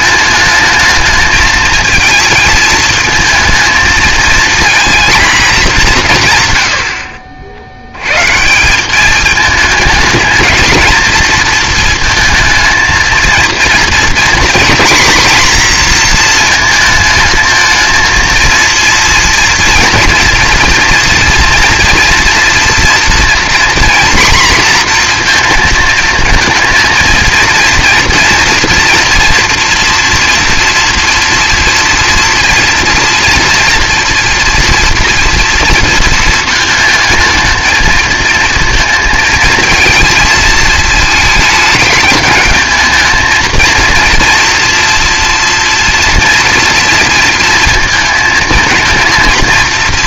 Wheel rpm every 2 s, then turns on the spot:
220, 230, 230, 100, 170, 220, 220, 240, 230, 230, 230, 240, 240, 220, 230, 230, 230, 230, 220, 220, 230, 210, 230, 240, 230.
none